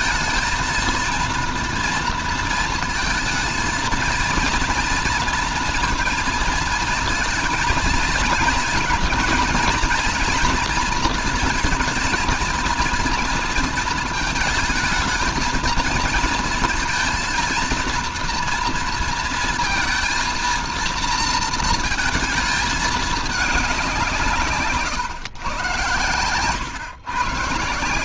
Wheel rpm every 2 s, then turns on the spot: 230, 230, 230, 230, 220, 230, 230, 230, 230, 230, 230, 220, 140, 120.
none